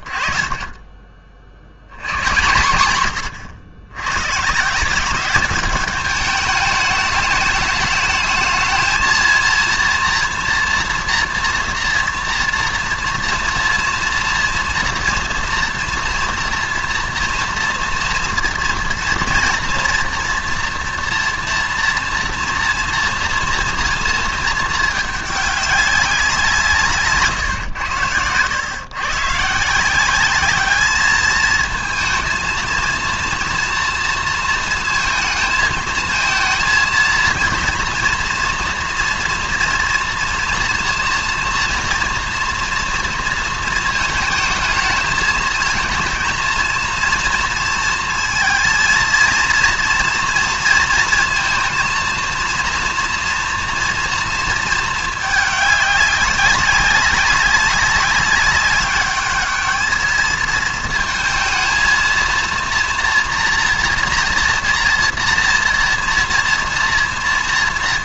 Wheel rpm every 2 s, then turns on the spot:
40, 120, 130, 210, 220, 230, 230, 230, 230, 230, 240, 230, 220, 160, 110, 200, 230, 230, 230, 230, 230, 230, 220, 230, 230, 230, 230, 230, 200, 200, 220, 230, 240, 230.
none